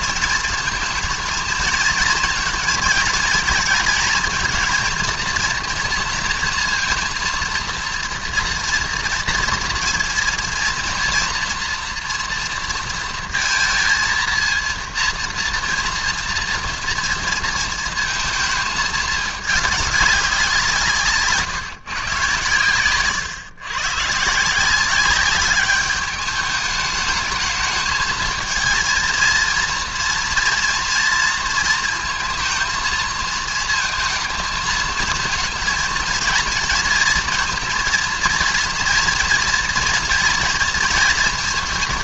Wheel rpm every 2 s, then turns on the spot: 230, 220, 220, 230, 230, 230, 230, 230, 230, 220, 150, 110, 180, 210, 230, 230, 230, 220, 230, 230, 230.
22-24